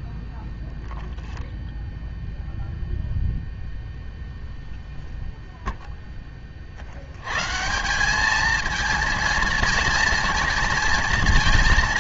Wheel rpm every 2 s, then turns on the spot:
0, 0, 0, 30, 220, 230.
none